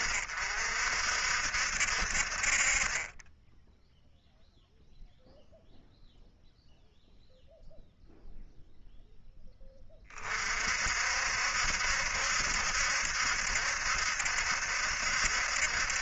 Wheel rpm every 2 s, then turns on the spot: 60, 10, 0, 0, 30, 60, 70, 70.
none